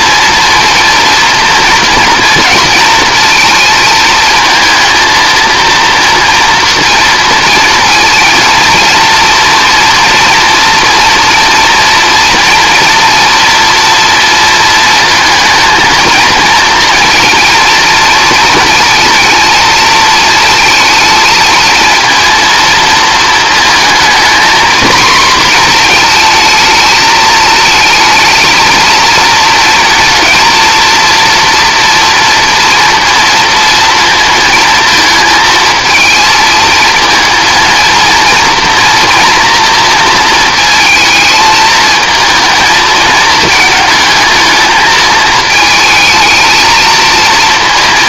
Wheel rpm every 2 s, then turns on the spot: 230, 220, 220, 230, 230, 240, 230, 220, 230, 220, 230, 230, 240, 220, 220, 230, 230, 220, 230, 240, 220, 220, 220, 220.
none